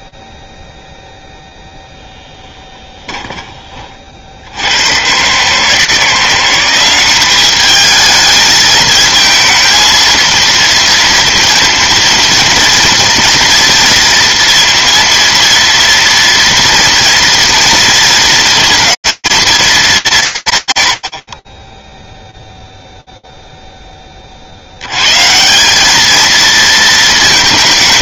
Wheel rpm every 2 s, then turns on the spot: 0, 0, 30, 150, 210, 220, 230, 230, 230, 230, 190, 0, 60, 220.
none